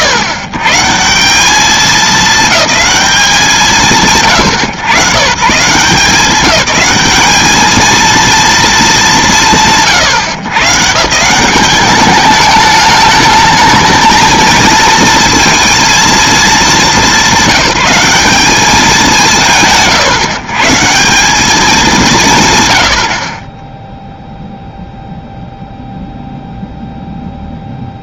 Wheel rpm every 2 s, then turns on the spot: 110, 210, 100, 190, 210, 140, 200, 230, 200, 180, 140, 60, 0, 0.
none